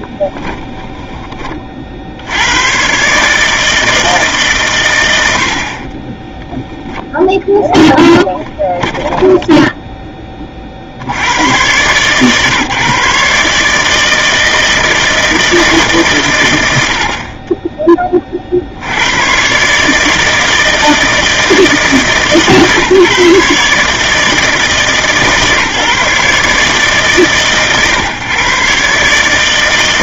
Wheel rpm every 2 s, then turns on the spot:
10, 100, 140, 10, 10, 30, 140, 160, 100, 60, 160, 150, 150, 140, 130.
0-2 6-10